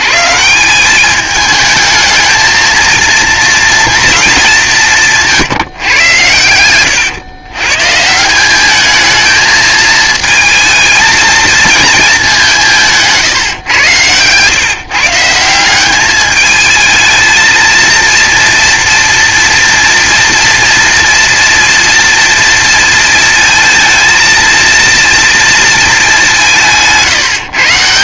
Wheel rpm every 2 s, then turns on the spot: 190, 230, 190, 110, 210, 230, 170, 140, 220, 230, 230, 230, 230, 170.
none